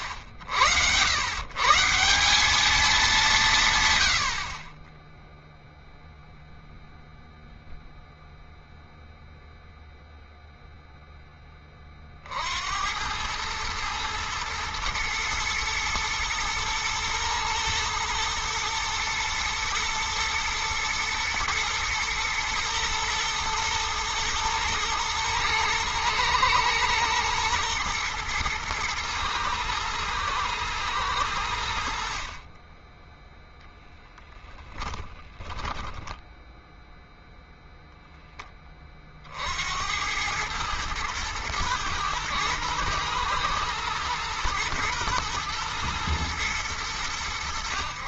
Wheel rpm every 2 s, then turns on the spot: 180, 90, 0, 0, 0, 70, 110, 120, 110, 110, 110, 110, 110, 110, 120, 40, 10, 10, 10, 90, 110, 120, 120, 90.
34-36